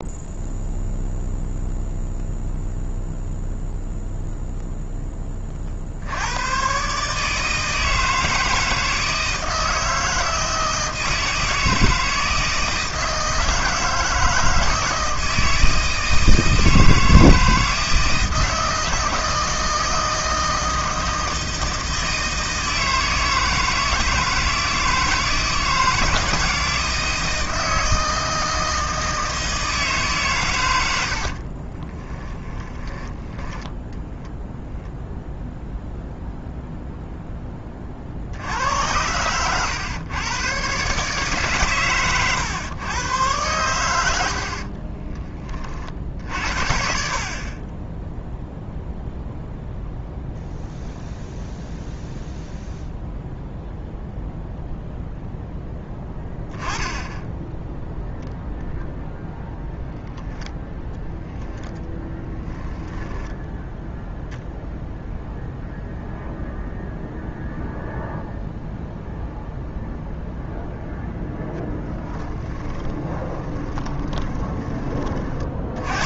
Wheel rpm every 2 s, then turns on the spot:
0, 0, 10, 140, 160, 160, 160, 160, 160, 160, 160, 160, 160, 160, 160, 80, 10, 0, 0, 90, 140, 120, 40, 60, 0, 0, 0, 0, 10, 0, 0, 10, 10, 0, 0, 0, 20, 30.
30-34 38-40 44-46 72-74